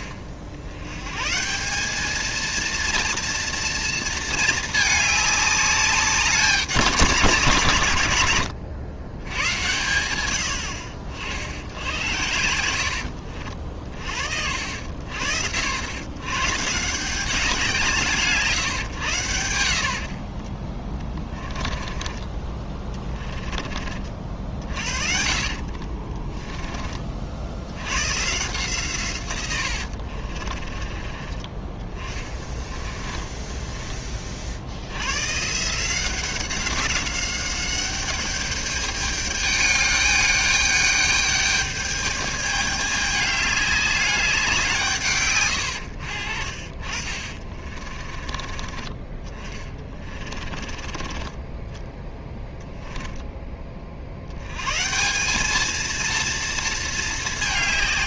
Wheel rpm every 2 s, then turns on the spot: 70, 230, 210, 200, 100, 70, 80, 90, 150, 130, 30, 30, 50, 20, 150, 40, 20, 70, 190, 200, 210, 210, 160, 50, 30, 30, 10, 120, 230.
20-26 30-34 46-48 50-54